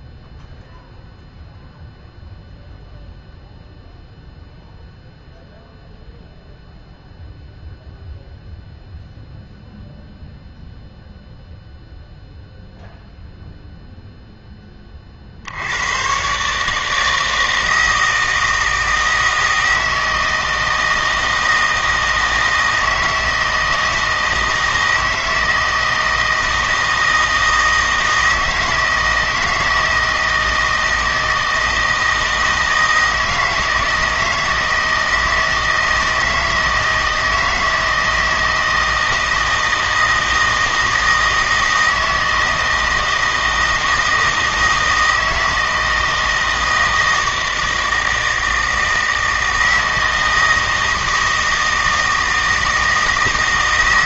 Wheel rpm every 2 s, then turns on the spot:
0, 0, 0, 0, 0, 0, 0, 20, 150, 160, 160, 160, 160, 160, 160, 160, 160, 160, 160, 160, 160, 160, 160, 160, 160, 160, 160.
none